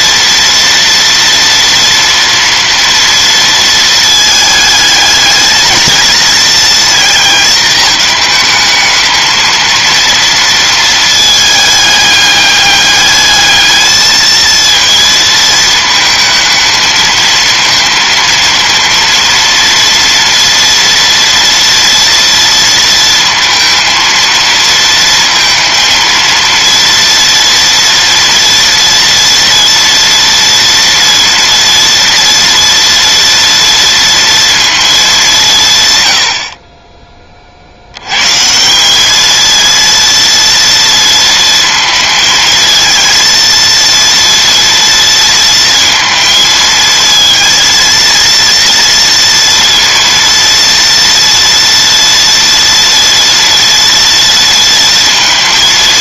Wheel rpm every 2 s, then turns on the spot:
230, 230, 220, 230, 220, 230, 210, 230, 220, 230, 240, 230, 230, 230, 230, 230, 230, 230, 40, 160, 230, 220, 230, 230, 230, 230, 230, 230.
none